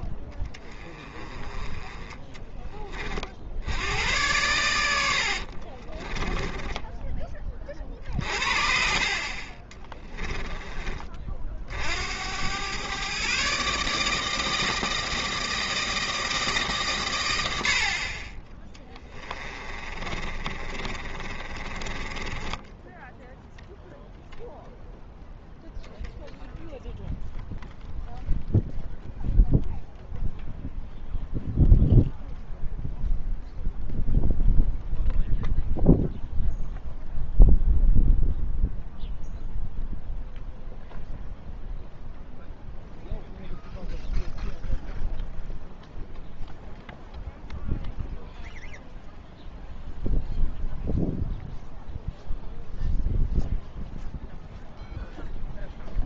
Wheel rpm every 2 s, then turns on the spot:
20, 20, 100, 10, 50, 20, 110, 160, 150, 20, 40, 10, 0, 0, 0, 0, 0, 0, 0, 0, 0, 0, 0, 0, 0, 0, 0, 0.
6-8 20-24